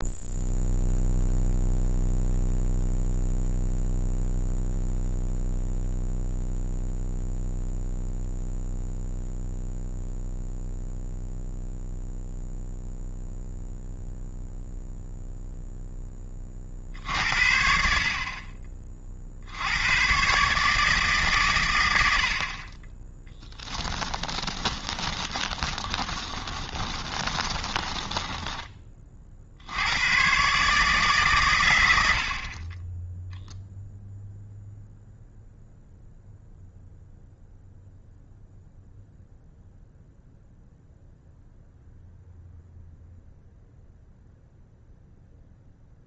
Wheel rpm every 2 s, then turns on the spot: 0, 0, 0, 0, 0, 0, 0, 0, 60, 60, 150, 10, 20, 20, 40, 150, 20, 0, 0, 0, 0, 0, 0.
24-28